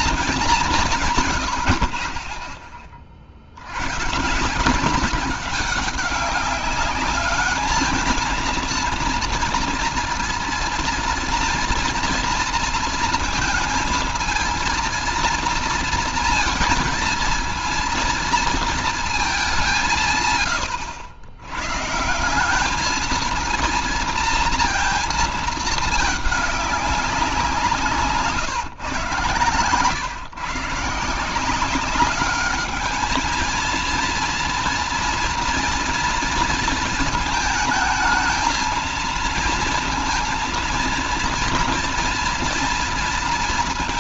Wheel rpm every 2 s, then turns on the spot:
190, 30, 190, 200, 230, 230, 230, 230, 230, 230, 110, 190, 230, 200, 130, 140, 210, 240, 230, 220, 230, 230.
none